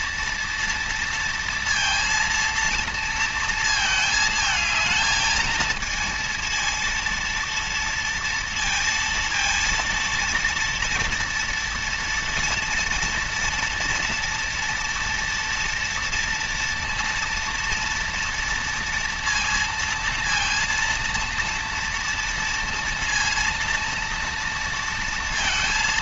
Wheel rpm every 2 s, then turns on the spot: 230, 230, 220, 230, 230, 230, 230, 230, 230, 230, 230, 230, 230.
none